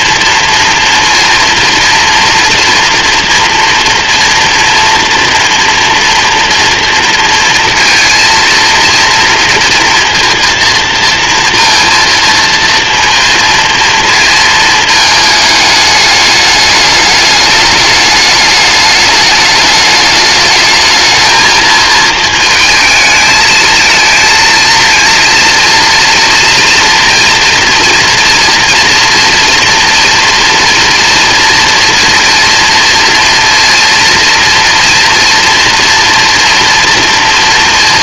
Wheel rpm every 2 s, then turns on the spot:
230, 230, 230, 230, 230, 230, 230, 220, 210, 210, 220, 220, 230, 230, 230, 240, 230, 240, 230.
none